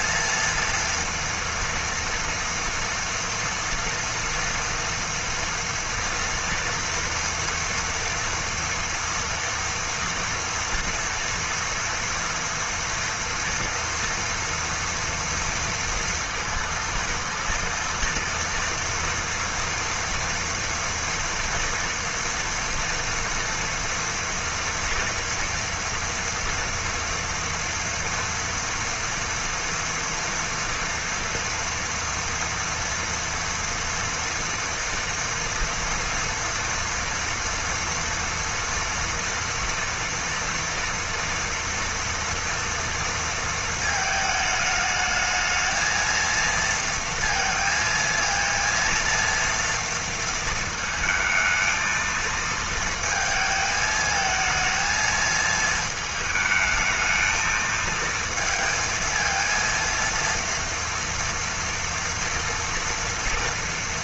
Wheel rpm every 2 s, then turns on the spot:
230, 230, 230, 240, 240, 230, 240, 230, 230, 230, 230, 230, 230, 230, 240, 240, 230, 230, 230, 230, 230, 230, 220, 230, 230, 220, 230, 220, 220, 230, 230, 230.
none